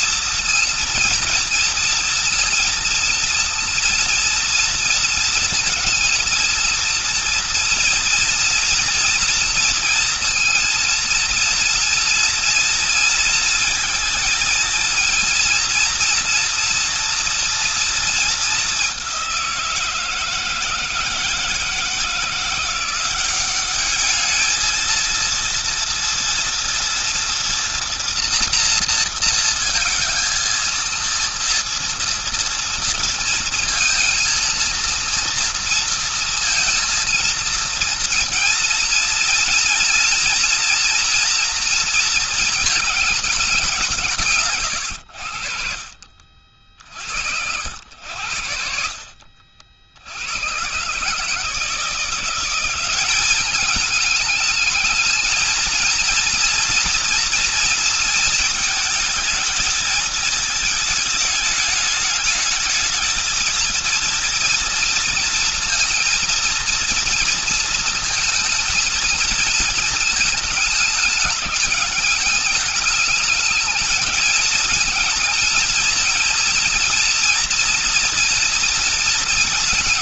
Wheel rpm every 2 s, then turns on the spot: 230, 230, 230, 230, 230, 230, 230, 230, 230, 220, 170, 170, 220, 230, 230, 230, 230, 230, 230, 230, 240, 230, 140, 40, 90, 90, 180, 210, 240, 230, 220, 210, 230, 230, 230, 220, 210, 220, 230, 230.
none